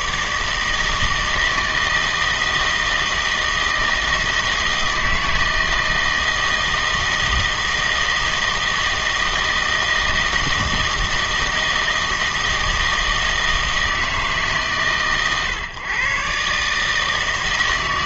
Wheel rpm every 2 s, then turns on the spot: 160, 160, 160, 160, 160, 160, 160, 140, 150.
none